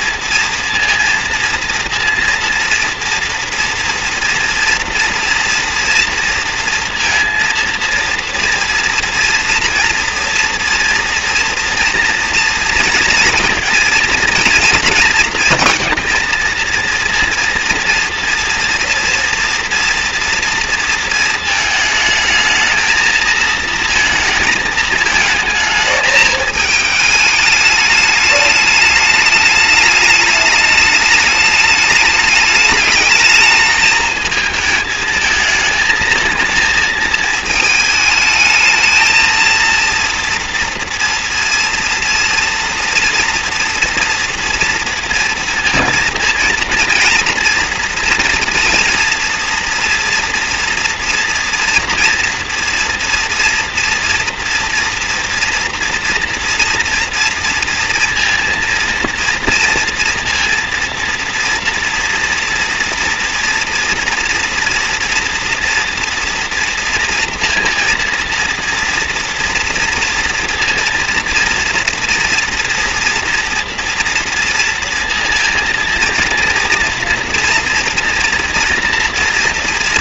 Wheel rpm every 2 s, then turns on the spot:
230, 230, 240, 230, 230, 230, 230, 230, 230, 230, 230, 220, 220, 210, 210, 210, 210, 220, 220, 220, 230, 230, 230, 230, 230, 230, 230, 240, 230, 230, 230, 230, 230, 230, 230, 230, 230, 230, 230, 230.
none